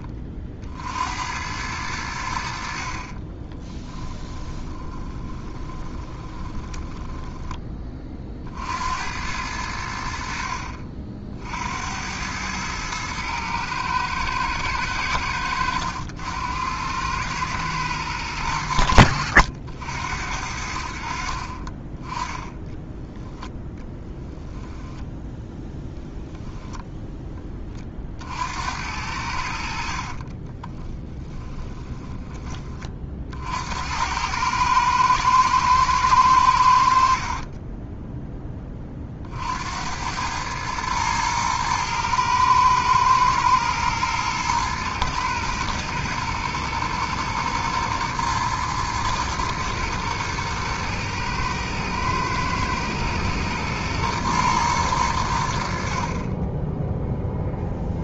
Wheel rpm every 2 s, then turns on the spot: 50, 50, 20, 10, 70, 50, 110, 100, 90, 90, 70, 10, 10, 0, 80, 20, 30, 110, 80, 20, 110, 110, 120, 120, 110, 110, 110, 110, 0.
4-8 24-26 30-32